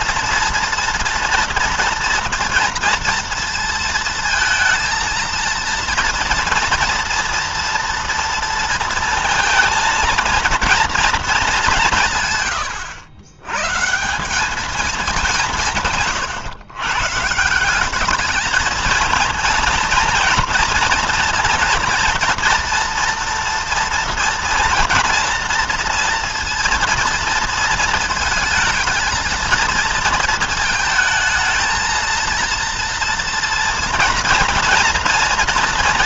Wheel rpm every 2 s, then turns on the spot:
230, 230, 230, 230, 230, 230, 130, 210, 130, 210, 230, 240, 230, 230, 220, 220, 230, 230.
12-14